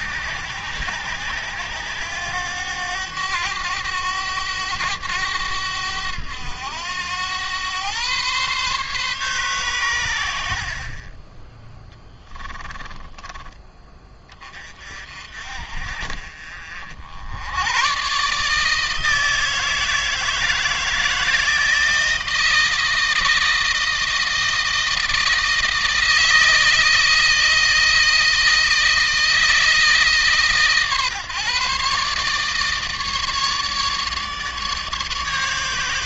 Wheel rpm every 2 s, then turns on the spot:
90, 100, 100, 100, 130, 40, 20, 40, 60, 160, 160, 160, 160, 160, 160, 140, 150, 150.
10-14